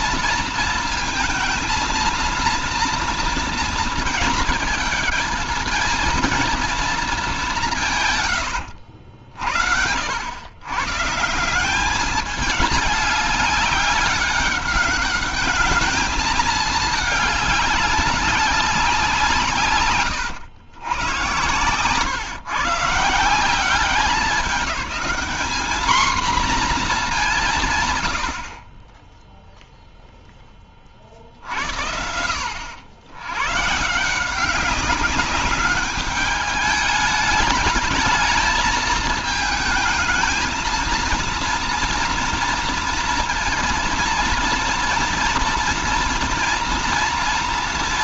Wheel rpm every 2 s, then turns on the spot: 230, 230, 220, 230, 100, 120, 210, 200, 220, 200, 120, 140, 200, 230, 30, 20, 80, 190, 210, 220, 220, 230, 230, 230.
none